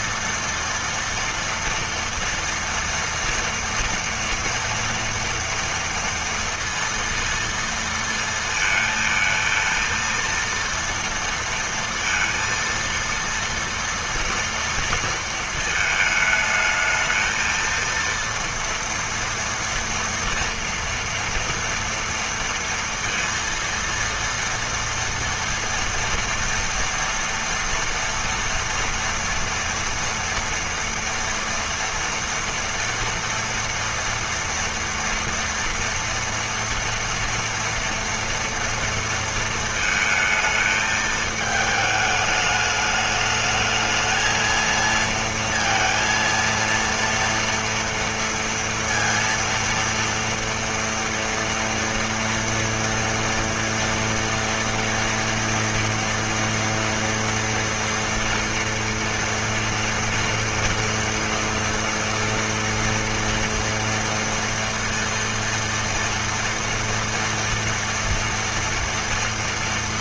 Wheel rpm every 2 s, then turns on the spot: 230, 230, 230, 230, 230, 230, 230, 230, 220, 230, 230, 230, 230, 230, 230, 240, 230, 230, 230, 230, 220, 210, 230, 230, 230, 230, 230, 230, 230, 230, 230, 230, 240, 230, 230.
none